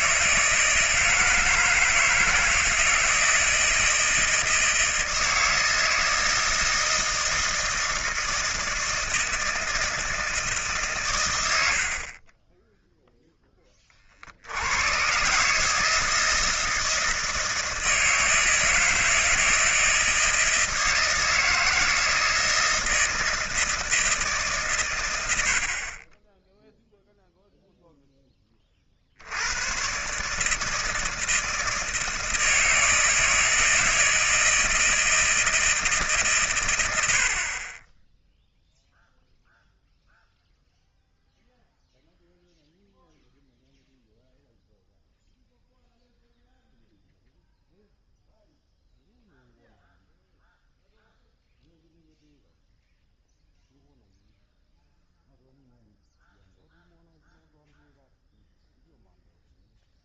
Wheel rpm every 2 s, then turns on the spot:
160, 160, 160, 160, 160, 150, 10, 80, 160, 160, 160, 160, 140, 10, 20, 150, 160, 160, 110, 0, 0, 0, 0, 0, 0, 0, 0, 0, 0, 0.
none